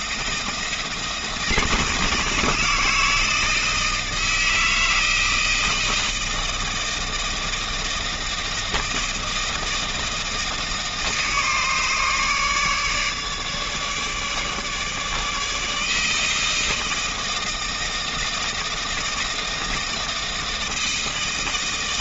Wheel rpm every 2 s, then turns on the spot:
160, 160, 160, 160, 160, 160, 150, 150, 160, 160, 160.
none